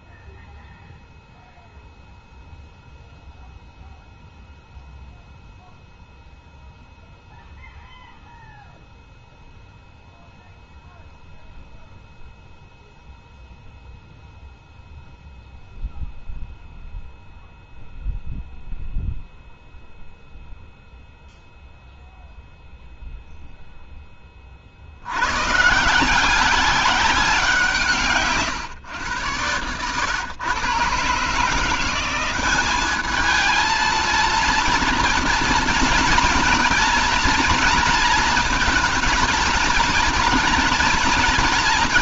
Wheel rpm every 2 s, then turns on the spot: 0, 0, 0, 0, 0, 0, 0, 0, 0, 0, 0, 0, 40, 190, 130, 120, 190, 230, 230, 230, 220.
none